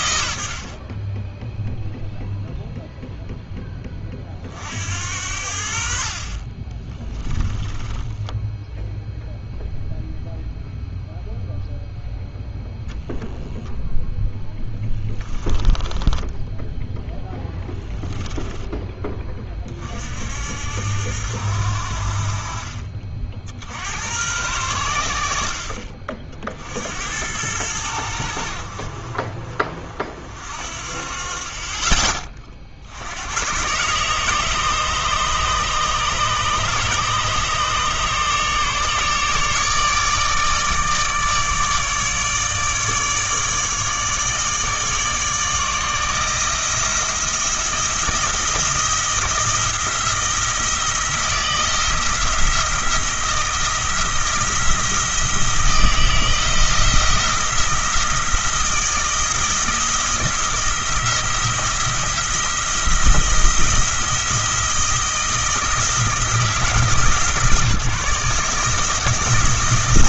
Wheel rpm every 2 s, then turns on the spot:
50, 0, 60, 30, 0, 0, 0, 10, 0, 10, 70, 40, 100, 70, 60, 50, 50, 150, 150, 150, 150, 150, 150, 160, 170, 170, 170, 170, 170, 170, 170, 170, 170, 160, 150.
14-16